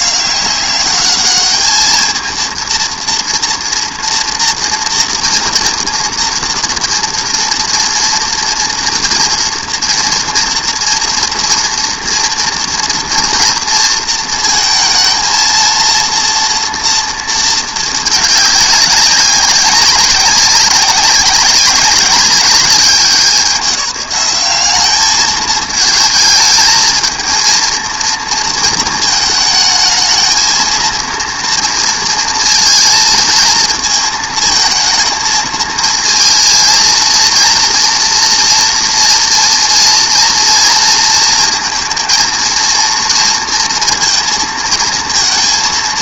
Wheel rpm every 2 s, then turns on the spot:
200, 230, 230, 240, 230, 230, 230, 220, 230, 200, 190, 190, 190, 220, 230, 220, 230, 220, 230, 240, 230, 230, 230.
none